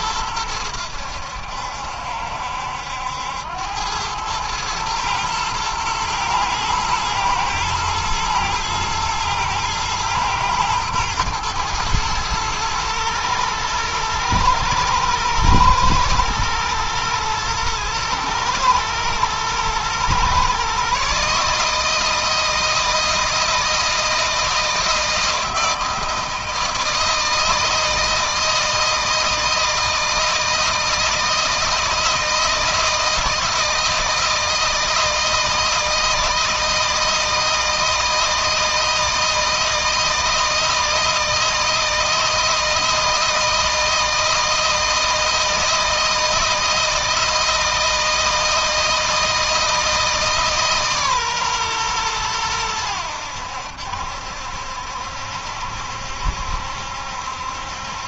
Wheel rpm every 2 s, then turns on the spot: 90, 80, 110, 110, 110, 120, 110, 110, 110, 110, 140, 160, 160, 160, 160, 160, 160, 160, 160, 160, 160, 160, 160, 160, 160, 140, 90, 70, 70.
none